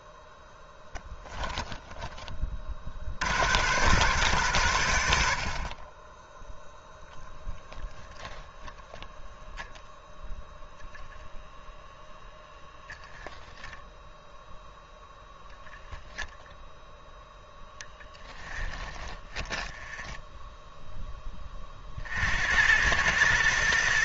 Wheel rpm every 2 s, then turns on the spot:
10, 40, 100, 10, 10, 0, 10, 0, 0, 10, 0, 100.
18-20